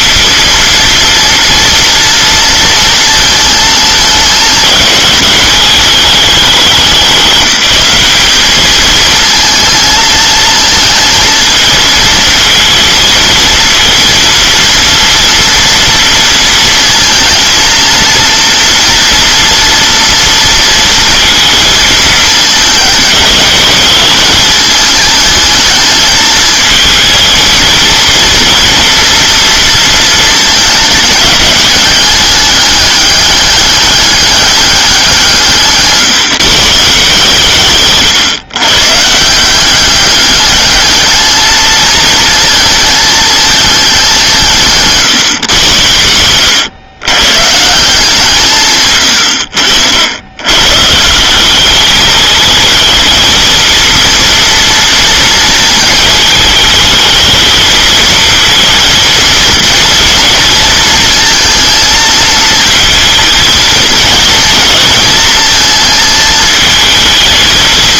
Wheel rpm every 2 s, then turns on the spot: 230, 230, 210, 200, 220, 220, 230, 230, 230, 230, 230, 220, 220, 220, 230, 210, 200, 190, 160, 160, 220, 220, 140, 110, 130, 150, 220, 230, 220, 230, 230, 220, 220, 220.
none